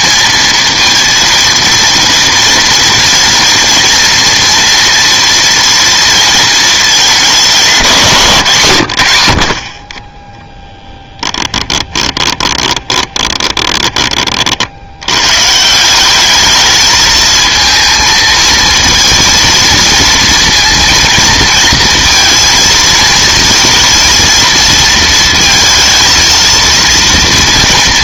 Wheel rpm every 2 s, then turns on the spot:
230, 230, 230, 230, 190, 30, 20, 30, 200, 220, 230, 230, 230, 230.
12-14